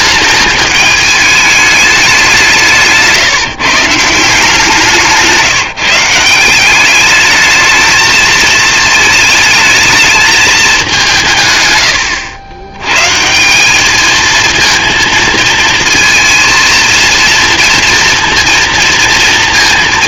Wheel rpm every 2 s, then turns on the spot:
210, 160, 170, 210, 220, 180, 140, 230, 230, 230.
4-6